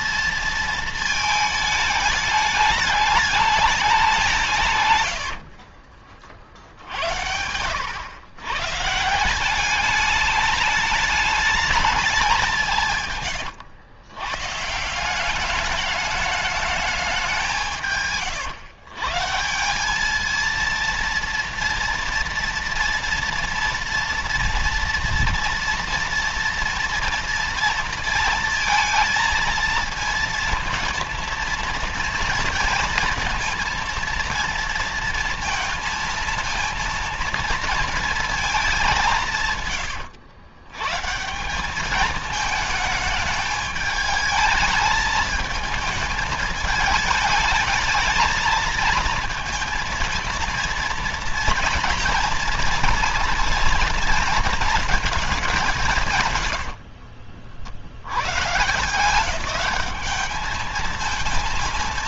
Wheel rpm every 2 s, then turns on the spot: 230, 210, 160, 50, 130, 210, 170, 140, 210, 130, 230, 230, 230, 240, 230, 230, 230, 230, 230, 210, 110, 220, 220, 210, 220, 230, 230, 230, 110, 140, 220.
4-6 56-58